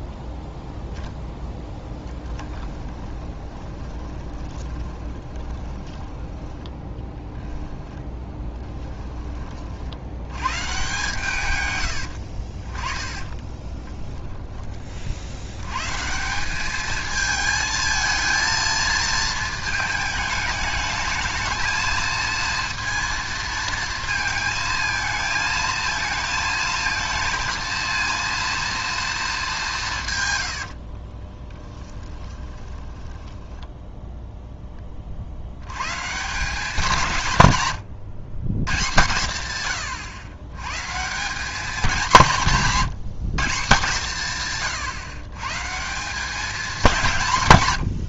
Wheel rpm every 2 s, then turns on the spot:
0, 10, 20, 10, 10, 130, 30, 40, 210, 230, 210, 230, 220, 230, 230, 50, 20, 10, 180, 130, 130, 180, 130, 200.
2-8 30-34